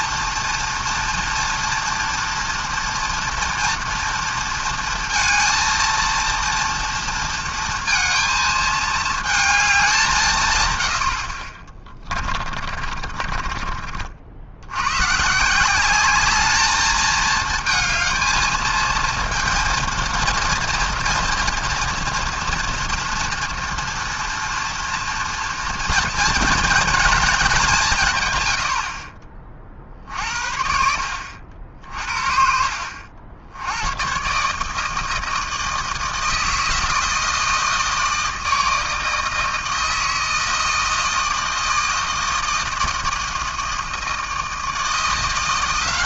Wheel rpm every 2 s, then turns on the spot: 230, 230, 230, 230, 220, 110, 40, 90, 220, 230, 230, 240, 240, 230, 90, 60, 60, 150, 160, 160, 160, 160, 160.
12-14